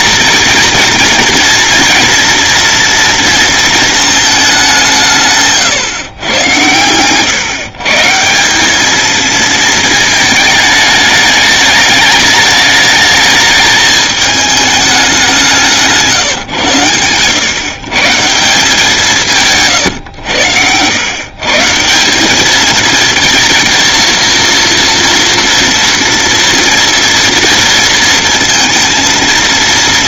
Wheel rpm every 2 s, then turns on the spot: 230, 240, 170, 110, 220, 210, 210, 200, 110, 170, 110, 220, 230, 230, 230.
none